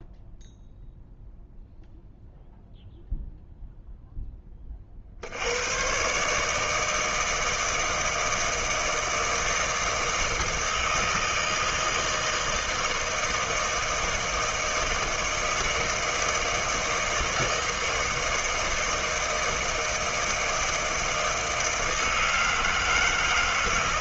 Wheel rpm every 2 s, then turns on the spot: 0, 0, 30, 160, 160, 160, 160, 160, 160, 160, 160, 160.
none